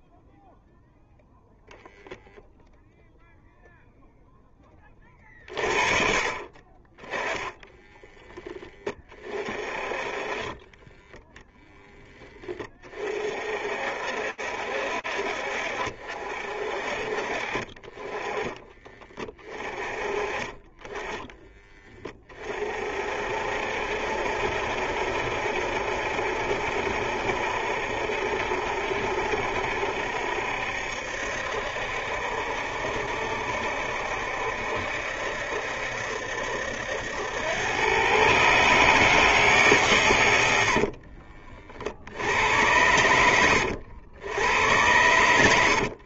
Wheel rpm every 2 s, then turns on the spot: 0, 0, 10, 30, 10, 30, 10, 60, 50, 30, 30, 30, 70, 70, 70, 70, 70, 70, 70, 140, 100, 80, 90.
10-12 40-42